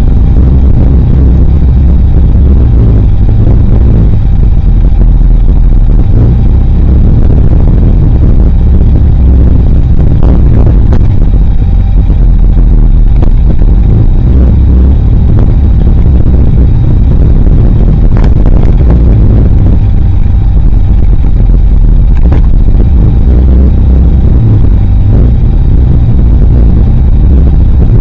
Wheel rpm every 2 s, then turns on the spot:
0, 0, 0, 0, 0, 0, 0, 0, 0, 0, 0, 0, 0, 0.
none